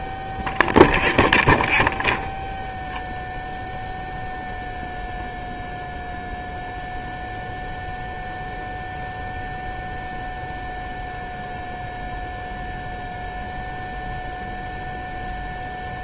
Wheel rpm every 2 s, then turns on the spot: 0, 0, 0, 0, 0, 0, 0, 0.
none